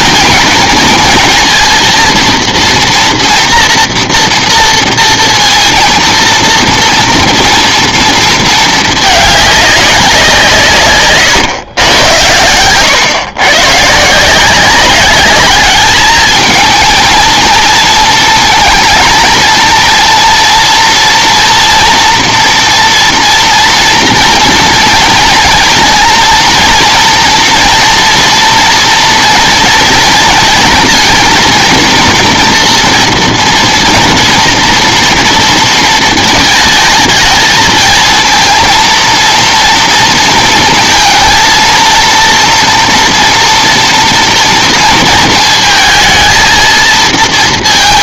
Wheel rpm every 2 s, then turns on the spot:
230, 240, 230, 230, 220, 160, 110, 180, 220, 230, 240, 240, 230, 240, 230, 230, 230, 230, 220, 230, 230, 230, 230, 220.
none